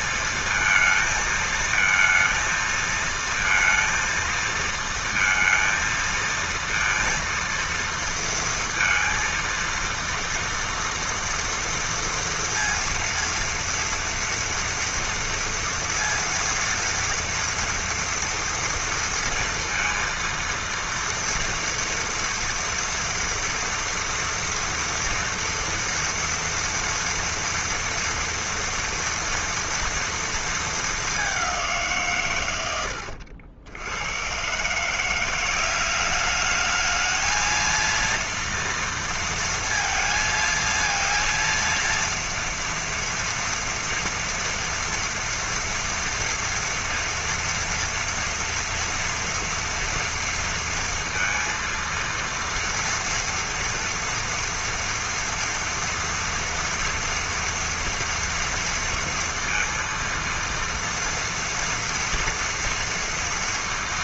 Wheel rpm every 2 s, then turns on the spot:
220, 230, 230, 230, 230, 230, 230, 230, 230, 230, 230, 230, 230, 240, 230, 220, 110, 130, 210, 230, 230, 230, 230, 230, 230, 230, 230, 230, 230, 230, 230, 230.
none